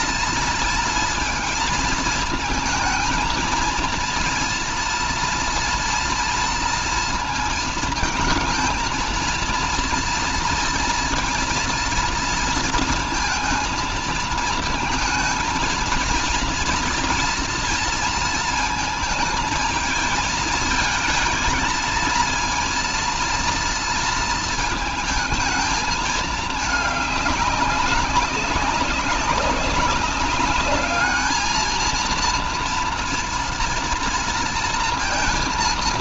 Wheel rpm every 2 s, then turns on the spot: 230, 220, 230, 230, 230, 230, 230, 220, 230, 230, 220, 230, 230, 210, 190, 210, 230, 230.
none